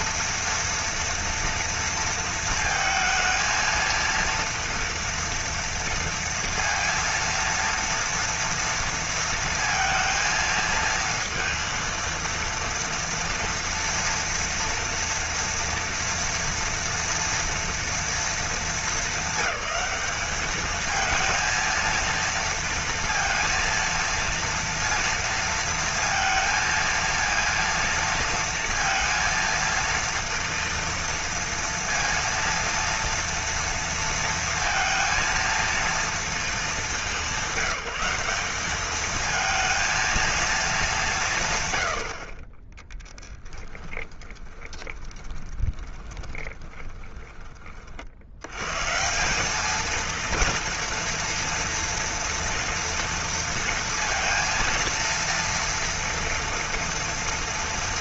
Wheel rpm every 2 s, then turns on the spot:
230, 230, 230, 230, 230, 230, 230, 230, 230, 230, 200, 230, 230, 230, 230, 230, 230, 230, 230, 200, 230, 40, 20, 20, 80, 230, 230, 230, 230.
44-48